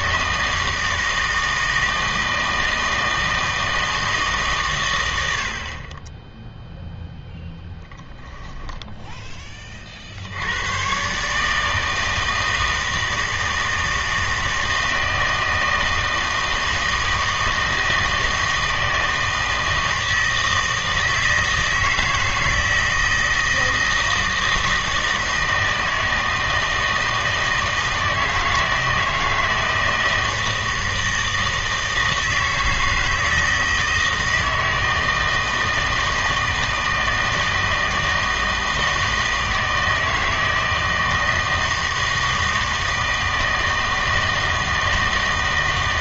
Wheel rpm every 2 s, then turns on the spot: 160, 160, 130, 0, 10, 110, 160, 160, 160, 160, 160, 160, 160, 160, 160, 160, 160, 160, 160, 160, 160, 160, 160.
none